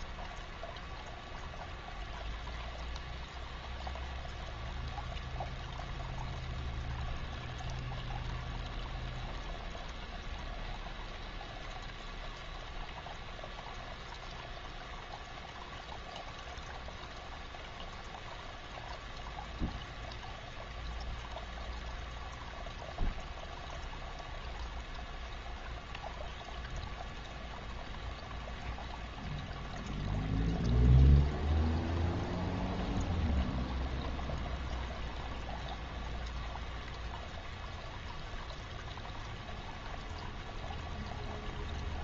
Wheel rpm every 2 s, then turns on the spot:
0, 0, 0, 0, 0, 0, 0, 0, 0, 0, 0, 0, 0, 0, 0, 0, 0, 0, 0, 0, 0.
none